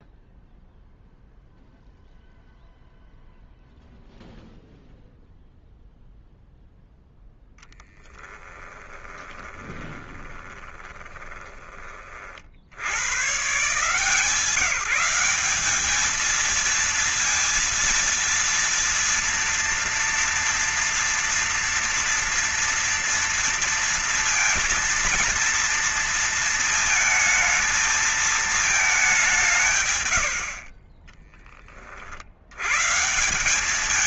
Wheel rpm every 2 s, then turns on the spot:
0, 0, 0, 0, 10, 20, 90, 170, 220, 230, 230, 230, 230, 220, 210, 40, 120.
8-12 30-32